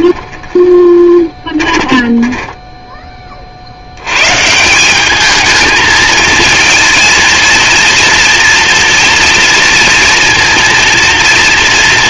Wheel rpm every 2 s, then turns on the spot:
20, 30, 220, 230, 240, 230.
0-2